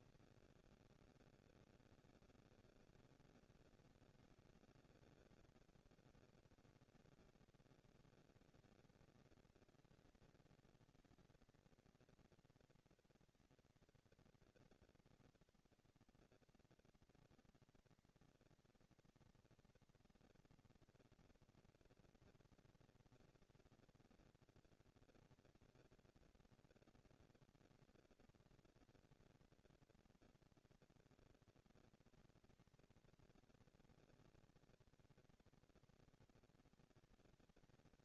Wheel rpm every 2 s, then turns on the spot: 220, 230, 230, 230, 220, 220, 230, 230, 230, 230, 240, 230, 230, 230, 230, 230, 230, 230, 230.
none